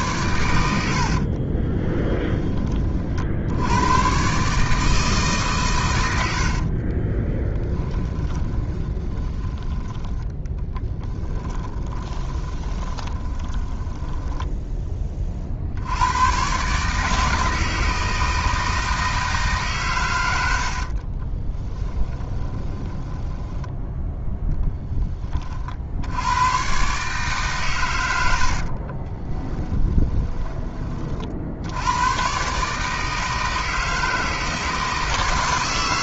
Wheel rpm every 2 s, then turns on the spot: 80, 20, 140, 70, 20, 10, 20, 10, 120, 160, 90, 20, 10, 100, 80, 20, 130, 160.
6-14 22-24 28-32